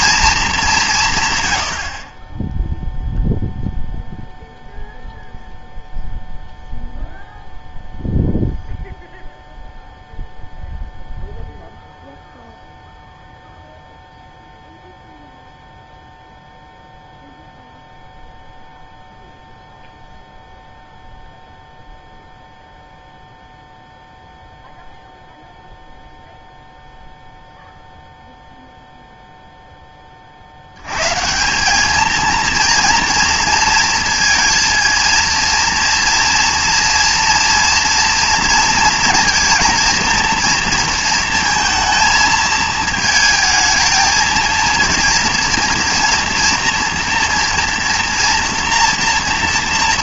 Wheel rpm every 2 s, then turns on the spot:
190, 0, 0, 0, 0, 0, 0, 0, 0, 0, 0, 0, 0, 0, 0, 90, 230, 230, 230, 230, 230, 220, 230, 230, 230.
none